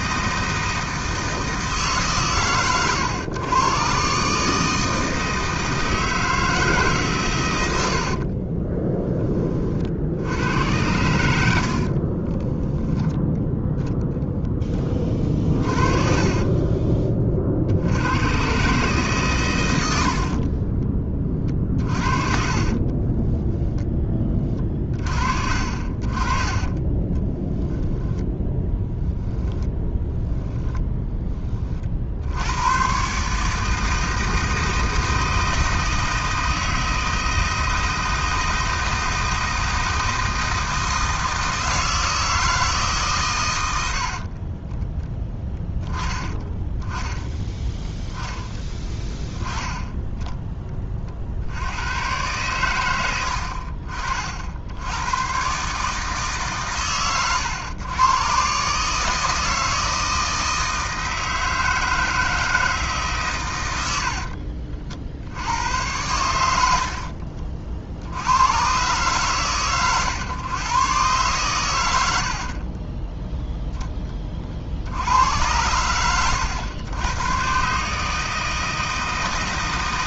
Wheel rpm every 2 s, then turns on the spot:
160, 110, 160, 140, 10, 80, 10, 20, 30, 140, 20, 20, 40, 30, 0, 10, 130, 160, 160, 160, 160, 150, 10, 10, 30, 30, 110, 90, 120, 150, 160, 150, 60, 60, 130, 120, 20, 70, 100, 160.
8-10 14-18 22-24 26-28 66-68 72-74